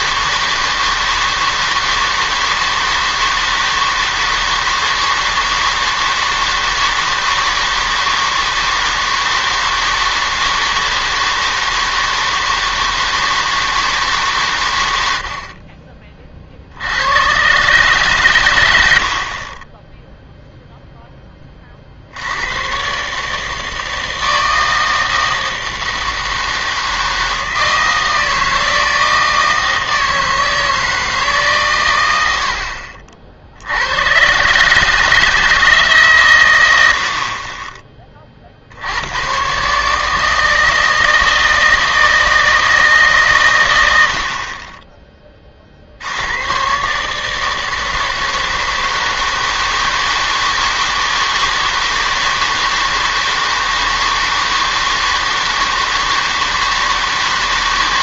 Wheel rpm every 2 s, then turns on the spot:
160, 160, 160, 160, 160, 160, 160, 120, 60, 100, 0, 120, 160, 160, 160, 160, 60, 150, 100, 70, 160, 160, 20, 120, 160, 160, 160, 160, 160.
none